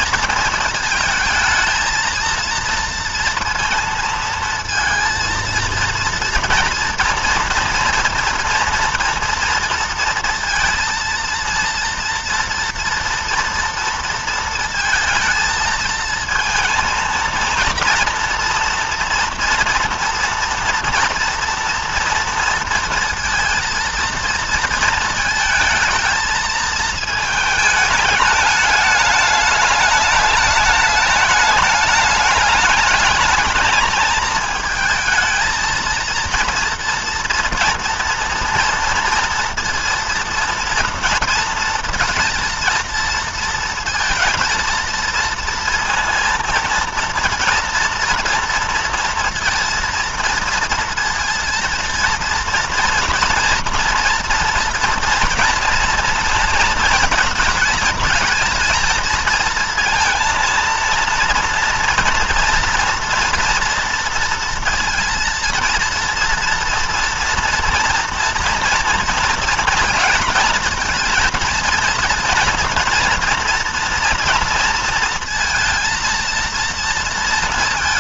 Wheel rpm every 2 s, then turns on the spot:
230, 230, 230, 230, 230, 230, 230, 230, 230, 230, 230, 230, 230, 220, 210, 210, 210, 220, 230, 240, 230, 230, 230, 230, 240, 230, 230, 240, 230, 220, 230, 240, 230, 240, 230, 230, 230, 230, 230.
none